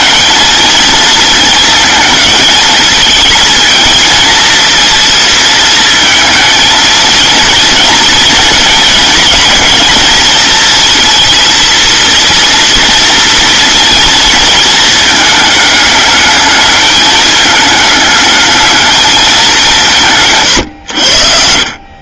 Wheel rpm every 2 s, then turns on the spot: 230, 220, 230, 230, 230, 220, 230, 220, 210, 220, 130.
20-22